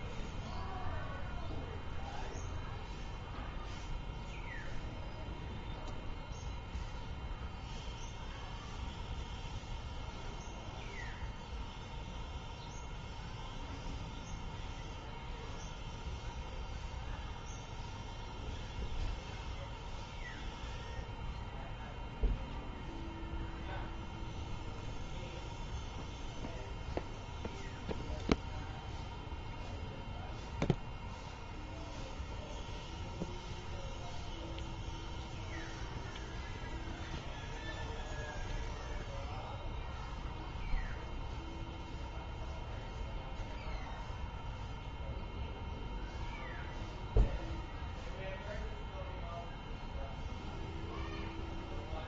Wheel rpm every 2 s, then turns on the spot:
0, 0, 0, 0, 0, 0, 0, 0, 0, 0, 0, 0, 0, 0, 0, 0, 0, 0, 0, 0, 0, 0, 0, 0, 0, 0.
none